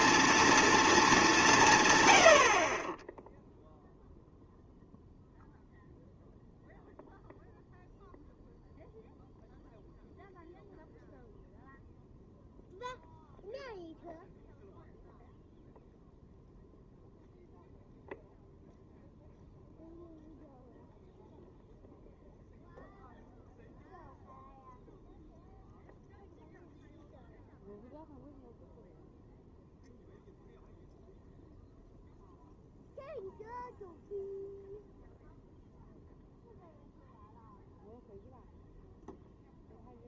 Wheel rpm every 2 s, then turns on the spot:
230, 70, 0, 0, 0, 0, 0, 0, 0, 0, 0, 0, 0, 0, 0, 0, 0, 0, 0, 0.
none